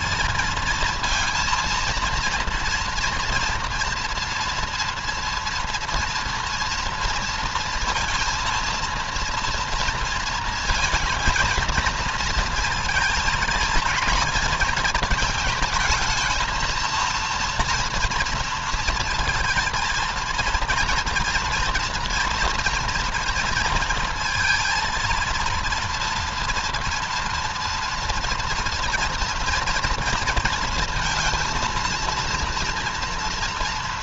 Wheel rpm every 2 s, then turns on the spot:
230, 230, 230, 230, 230, 230, 220, 220, 230, 230, 230, 230, 230, 230, 230, 230, 230.
none